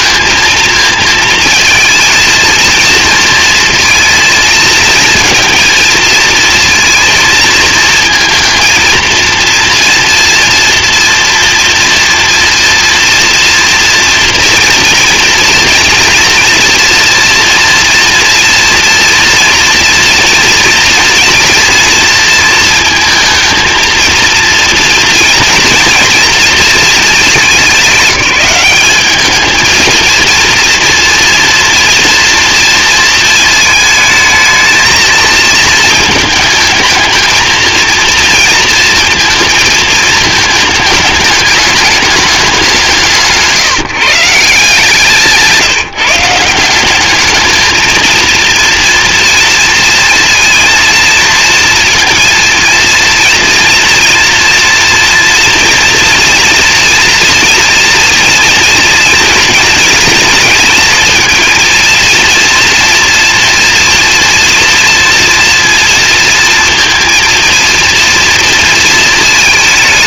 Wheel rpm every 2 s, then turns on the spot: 230, 230, 230, 230, 230, 230, 230, 230, 230, 230, 230, 230, 230, 220, 210, 230, 230, 220, 220, 230, 220, 170, 170, 200, 230, 230, 240, 230, 240, 230, 230, 230, 230, 230, 230.
none